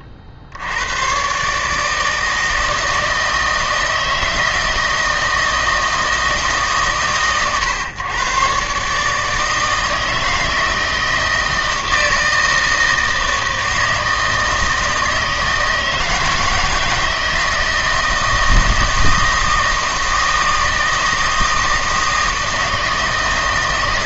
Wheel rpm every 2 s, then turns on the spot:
60, 160, 160, 150, 130, 160, 160, 160, 160, 160, 160, 160.
none